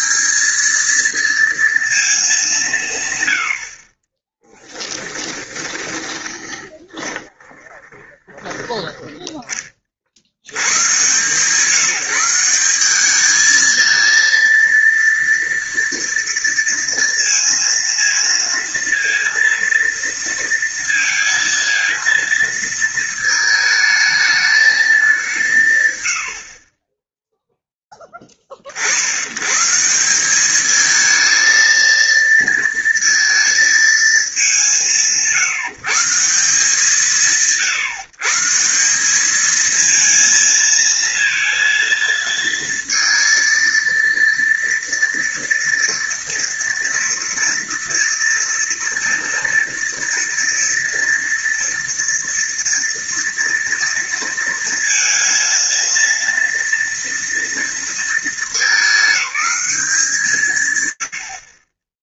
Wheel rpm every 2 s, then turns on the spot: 210, 180, 10, 20, 10, 90, 180, 230, 230, 230, 230, 230, 220, 40, 40, 210, 230, 190, 170, 180, 230, 230, 230, 230, 230, 230, 230, 230, 230, 210, 130.
4-8